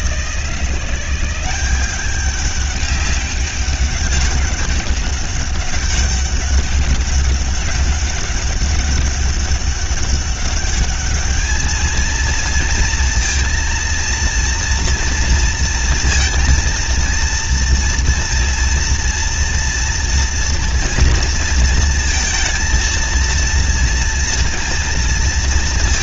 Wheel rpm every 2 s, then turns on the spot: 170, 200, 200, 200, 200, 200, 230, 230, 230, 230, 230, 230, 230.
none